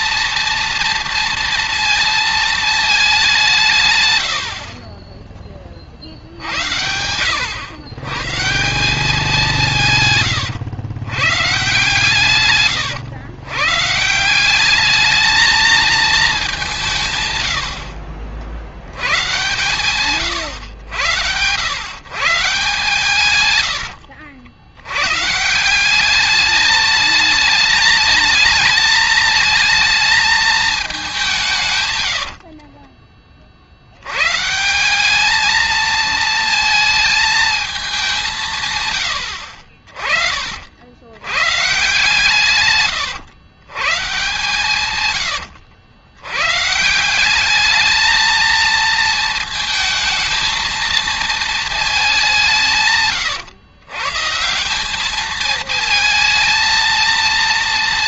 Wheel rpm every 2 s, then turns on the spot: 230, 220, 70, 80, 170, 110, 110, 190, 170, 70, 100, 140, 90, 210, 220, 210, 40, 170, 220, 140, 80, 130, 140, 140, 220, 230, 170, 180, 230.
32-34